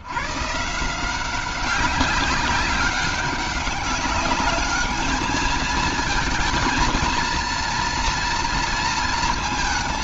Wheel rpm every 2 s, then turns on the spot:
130, 190, 210, 220, 230.
none